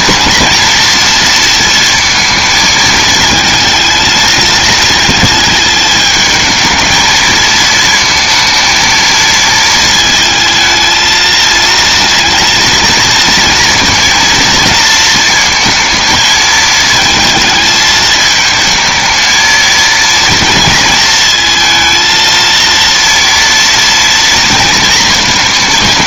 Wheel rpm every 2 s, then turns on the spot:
230, 220, 220, 220, 230, 220, 230, 220, 220, 220, 230, 230, 230.
none